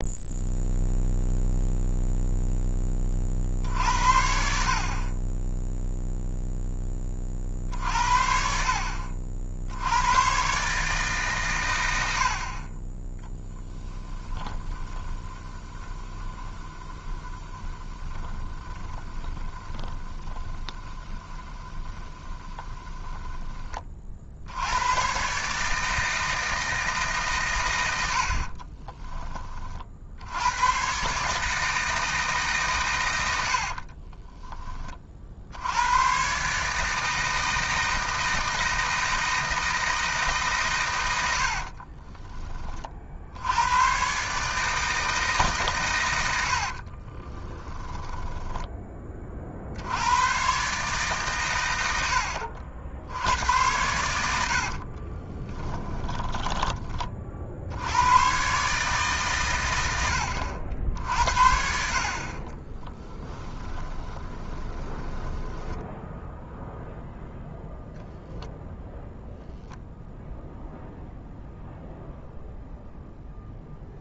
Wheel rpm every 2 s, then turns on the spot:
0, 20, 50, 10, 50, 140, 20, 20, 20, 20, 20, 10, 90, 160, 20, 120, 120, 10, 150, 160, 130, 40, 160, 60, 20, 140, 70, 50, 20, 140, 60, 20, 10, 0, 0, 0, 0.
14-24 28-30 46-48 54-56 62-66